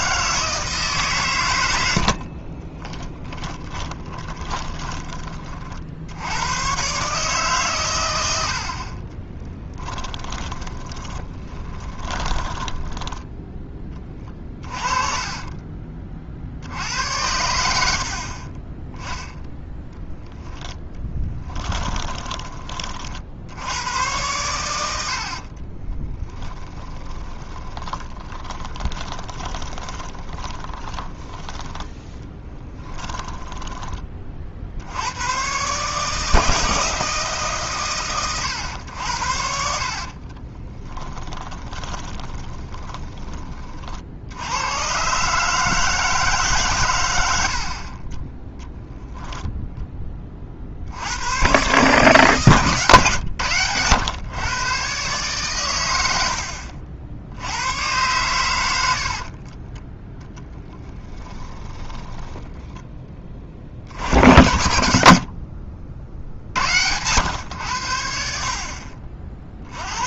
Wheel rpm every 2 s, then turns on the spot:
150, 20, 20, 110, 70, 20, 10, 30, 60, 20, 10, 30, 90, 20, 20, 20, 10, 50, 160, 110, 20, 20, 100, 130, 10, 50, 130, 130, 70, 90, 10, 10, 80, 80, 50.
2-6 10-16 20-22 26-34 40-44 60-62